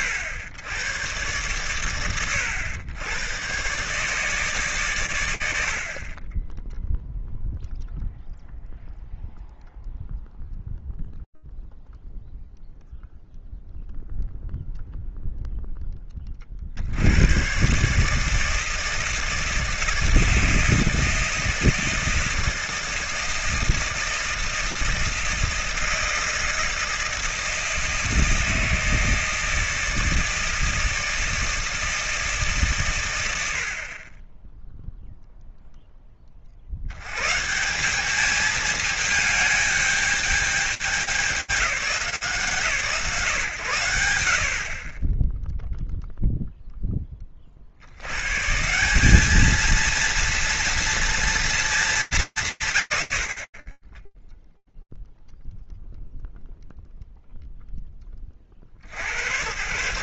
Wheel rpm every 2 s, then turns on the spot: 100, 110, 120, 0, 0, 0, 0, 0, 70, 160, 170, 160, 160, 160, 160, 160, 130, 0, 100, 220, 200, 130, 30, 10, 180, 230, 180, 0, 0, 50.
none